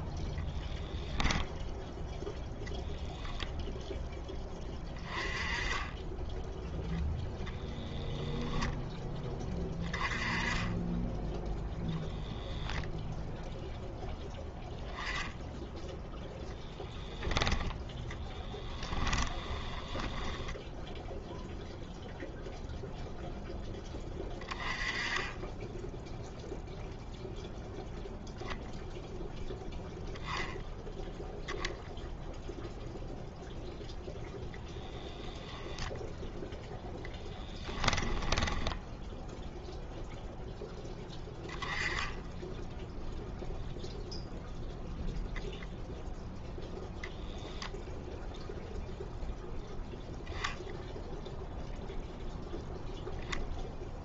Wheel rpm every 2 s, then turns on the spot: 0, 0, 20, 0, 10, 20, 0, 10, 10, 20, 0, 0, 20, 0, 0, 0, 0, 10, 0, 10, 10, 0, 0, 10, 0, 0, 0.
18-20 38-40